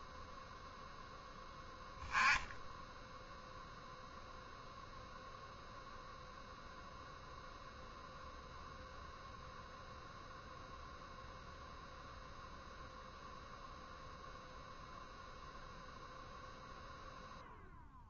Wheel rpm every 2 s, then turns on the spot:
10, 0, 0, 0, 0, 0, 0, 0, 0.
none